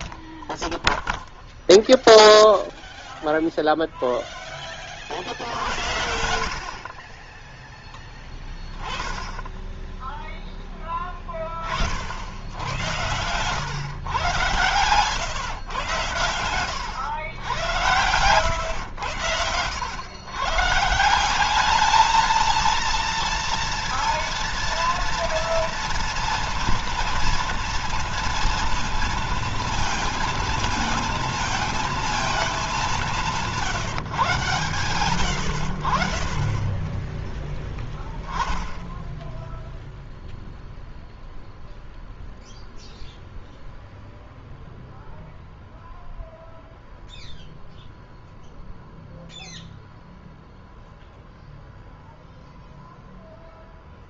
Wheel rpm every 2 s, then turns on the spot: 0, 0, 20, 50, 20, 10, 80, 120, 100, 110, 130, 220, 230, 230, 230, 230, 220, 140, 30, 10, 0, 0, 0, 0, 0, 0, 0.
36-38